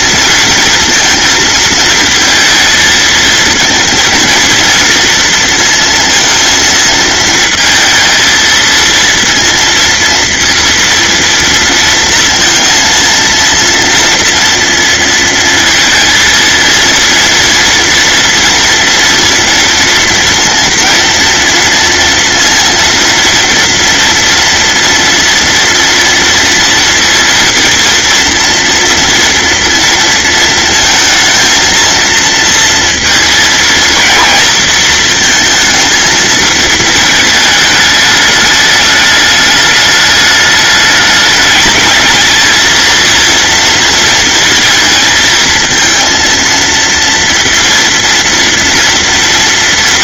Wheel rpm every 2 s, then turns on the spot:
220, 220, 230, 230, 230, 230, 230, 230, 230, 230, 230, 230, 230, 230, 230, 230, 230, 220, 220, 220, 210, 220, 220, 230, 230.
none